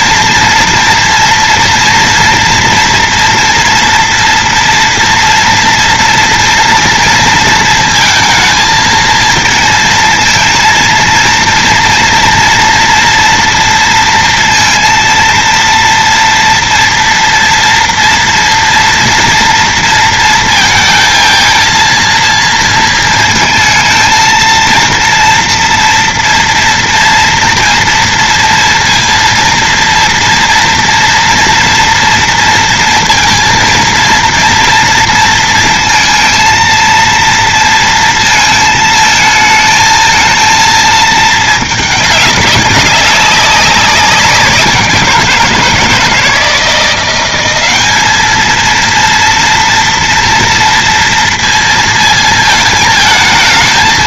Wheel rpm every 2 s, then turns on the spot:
230, 230, 230, 230, 230, 230, 230, 230, 240, 230, 220, 230, 230, 230, 230, 240, 230, 230, 230, 220, 220, 190, 180, 170, 230, 230, 220.
none